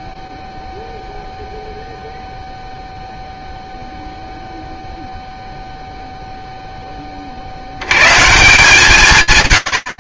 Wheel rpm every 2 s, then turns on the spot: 0, 0, 0, 20, 160.
none